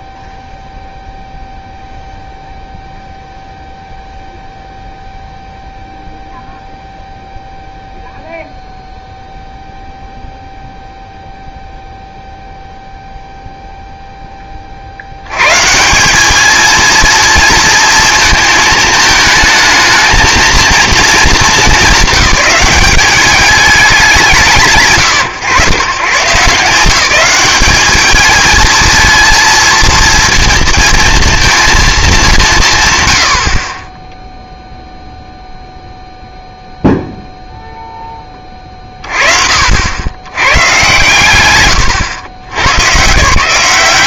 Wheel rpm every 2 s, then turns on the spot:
0, 0, 0, 0, 0, 0, 0, 30, 220, 220, 230, 190, 150, 160, 220, 230, 160, 0, 0, 20, 110, 90.
none